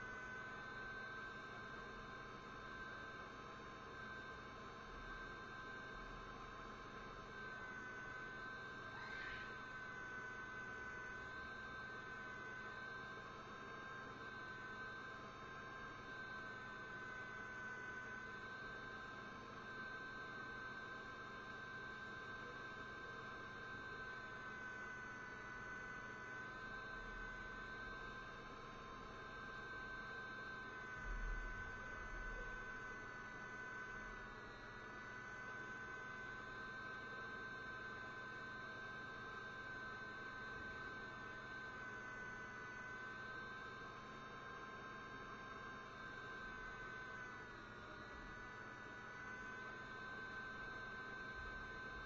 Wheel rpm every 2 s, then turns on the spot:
0, 0, 0, 0, 0, 0, 0, 0, 0, 0, 0, 0, 0, 0, 0, 0, 0, 0, 0, 0, 0, 0, 0, 0, 0, 0.
none